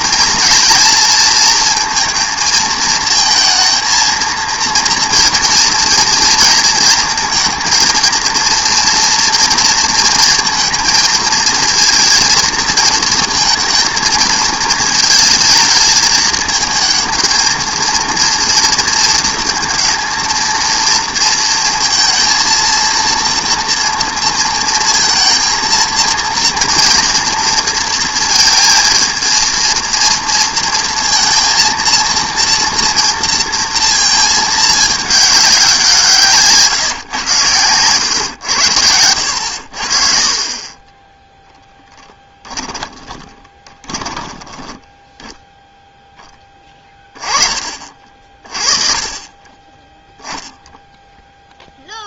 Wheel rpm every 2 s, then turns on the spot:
230, 230, 230, 230, 230, 230, 230, 220, 220, 230, 230, 230, 230, 230, 230, 230, 230, 210, 150, 90, 30, 20, 10, 10, 30, 0.
42-46